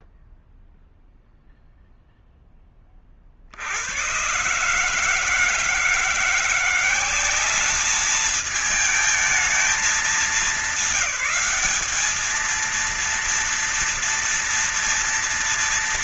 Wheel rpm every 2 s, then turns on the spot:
0, 10, 120, 180, 210, 210, 220, 230.
none